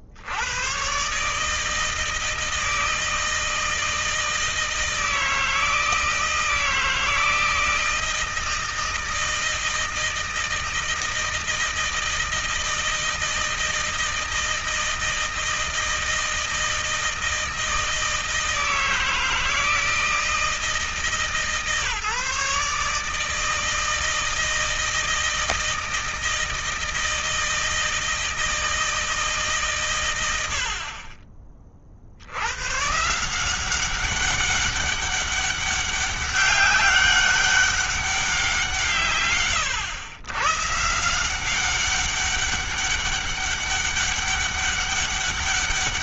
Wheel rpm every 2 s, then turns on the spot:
100, 160, 160, 160, 160, 160, 160, 160, 160, 160, 160, 150, 160, 160, 160, 50, 110, 190, 200, 170, 130, 200, 200.
none